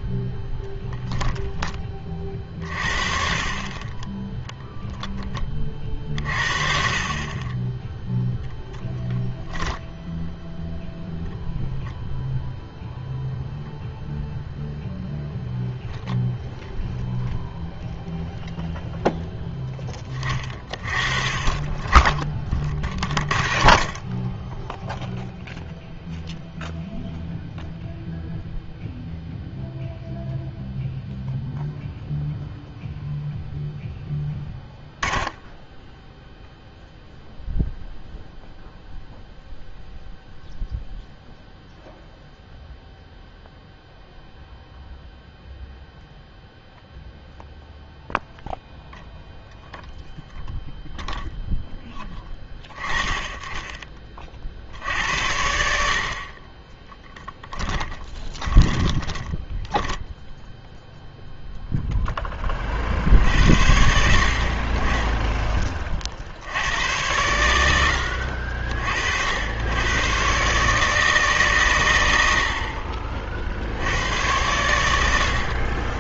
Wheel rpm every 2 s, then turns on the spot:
0, 40, 10, 50, 0, 0, 0, 0, 0, 0, 30, 40, 10, 0, 0, 0, 0, 10, 0, 0, 0, 0, 0, 0, 0, 0, 20, 70, 20, 10, 0, 50, 40, 90, 50, 140, 50, 90.
56-60